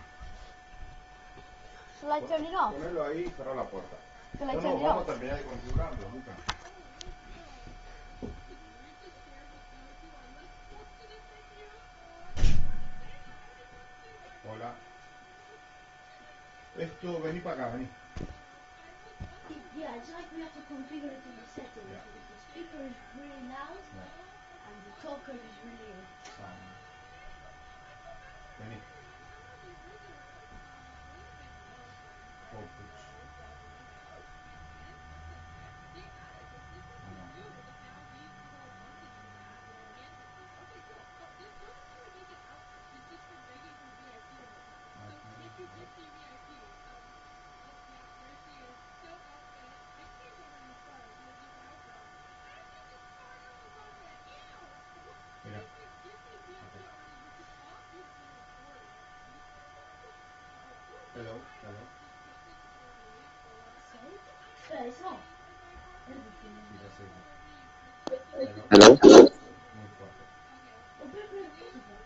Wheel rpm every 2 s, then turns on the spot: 0, 0, 0, 0, 0, 0, 0, 0, 0, 0, 0, 0, 0, 0, 0, 0, 0, 0, 0, 0, 0, 0, 0, 0, 0, 0, 0, 0, 0, 0, 0, 0, 0, 0, 0, 0.
none